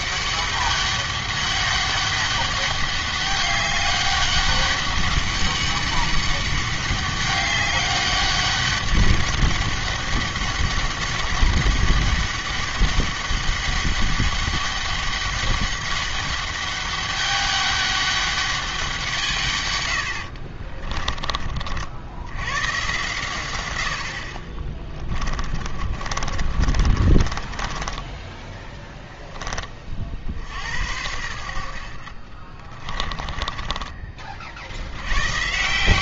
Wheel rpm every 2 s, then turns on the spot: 200, 200, 200, 200, 200, 200, 200, 200, 200, 180, 30, 120, 30, 40, 10, 80, 30, 80.
20-22 24-28 32-34